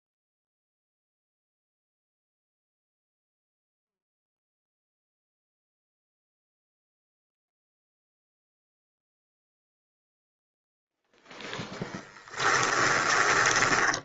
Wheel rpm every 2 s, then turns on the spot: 0, 0, 0, 0, 0, 0, 10.
12-14